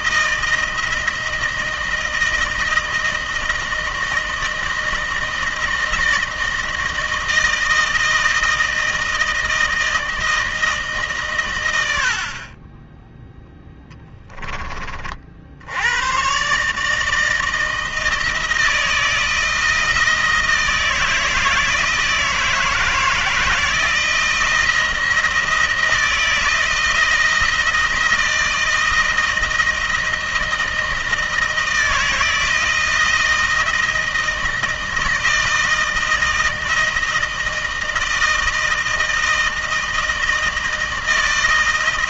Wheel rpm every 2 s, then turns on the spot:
160, 160, 160, 160, 160, 160, 40, 20, 130, 160, 160, 160, 170, 160, 160, 160, 160, 160, 160, 160, 160.
none